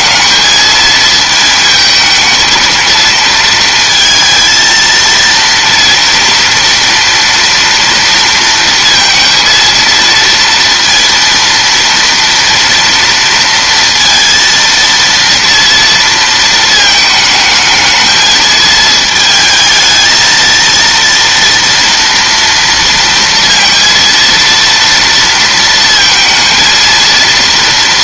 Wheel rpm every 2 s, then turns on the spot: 220, 220, 230, 230, 230, 230, 230, 230, 220, 220, 230, 230, 230, 220.
none